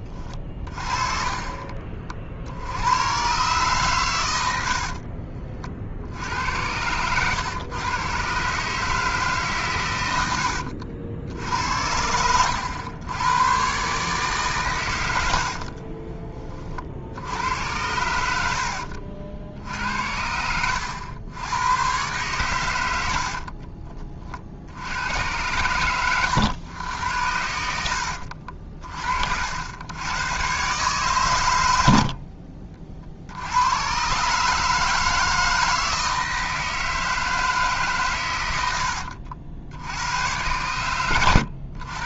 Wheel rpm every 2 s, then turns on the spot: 40, 90, 60, 100, 150, 70, 100, 100, 40, 70, 80, 100, 70, 100, 50, 130, 40, 160, 160, 80, 100.
0-2 4-8 38-40